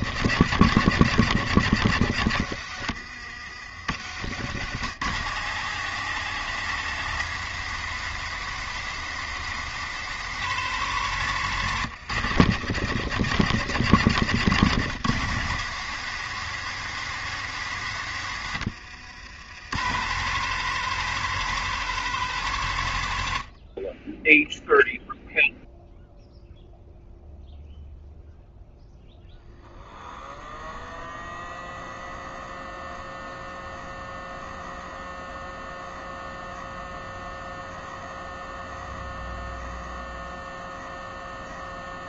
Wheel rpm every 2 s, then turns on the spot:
110, 70, 120, 130, 130, 120, 110, 120, 130, 80, 130, 70, 0, 0, 0, 0, 0, 0, 0, 0, 0.
none